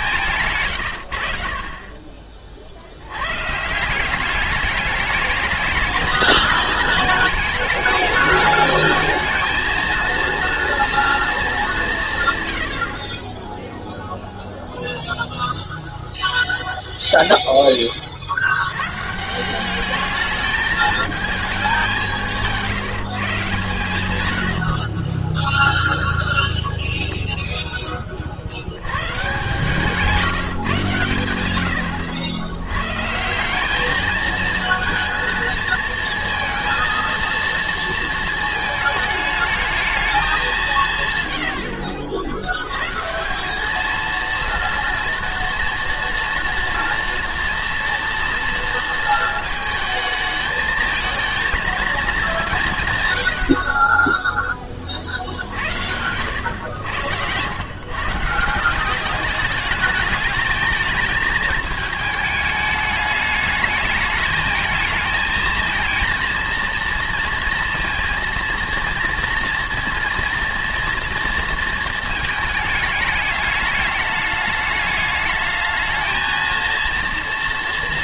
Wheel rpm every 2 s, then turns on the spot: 110, 50, 210, 210, 220, 230, 100, 0, 0, 90, 220, 160, 60, 0, 90, 130, 100, 230, 230, 220, 180, 100, 230, 230, 230, 220, 170, 30, 100, 180, 210, 210, 220, 230, 230, 230, 220, 210, 230.
0-2 24-26